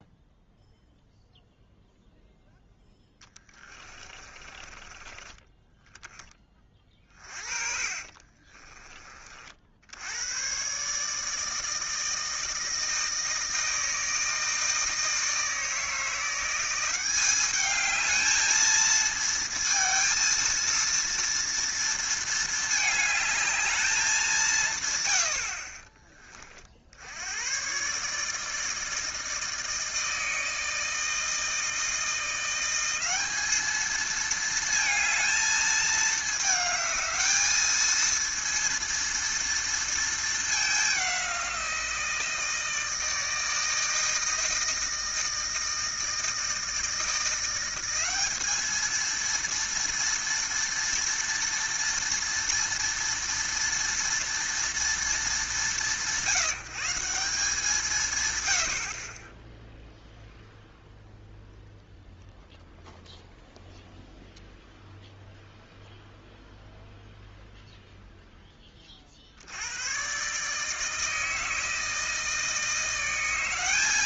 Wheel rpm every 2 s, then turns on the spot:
0, 0, 20, 20, 20, 120, 160, 160, 180, 220, 230, 220, 160, 40, 160, 160, 180, 220, 220, 230, 210, 160, 160, 160, 210, 240, 230, 230, 170, 90, 0, 0, 0, 0, 20, 150, 160.
6-8